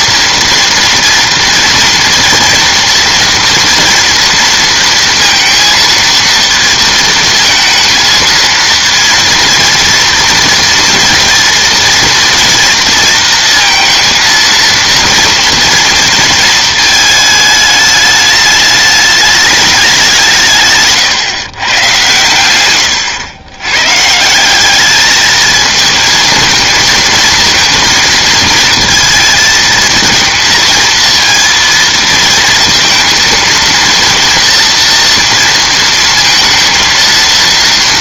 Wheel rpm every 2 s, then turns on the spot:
230, 230, 230, 230, 230, 230, 230, 230, 220, 210, 150, 110, 190, 230, 230, 230, 230, 230, 230.
none